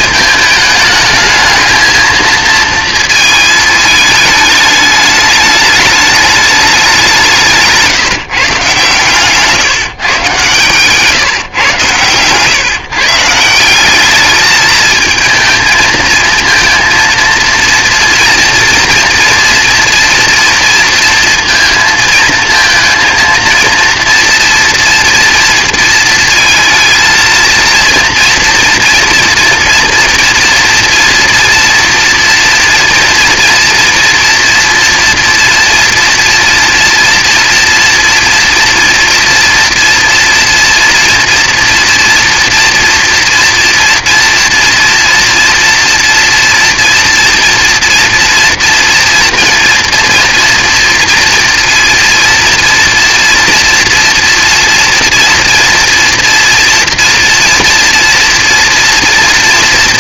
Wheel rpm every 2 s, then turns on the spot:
220, 230, 210, 210, 140, 130, 130, 220, 220, 230, 230, 220, 240, 230, 230, 230, 230, 230, 240, 230, 230, 230, 240, 230, 230, 230, 230, 230, 230, 230.
none